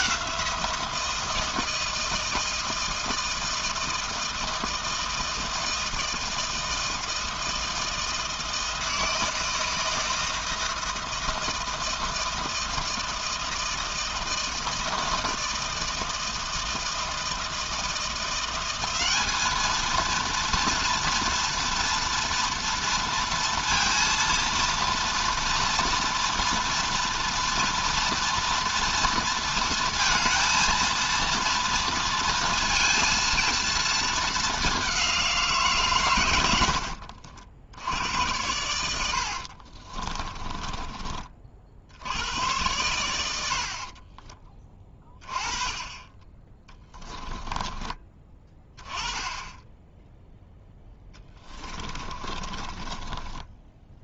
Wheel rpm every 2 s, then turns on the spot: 170, 160, 160, 160, 160, 160, 160, 160, 160, 200, 230, 230, 230, 230, 230, 230, 230, 190, 50, 80, 30, 100, 20, 10, 10, 10, 20.
38-40 46-48 50-54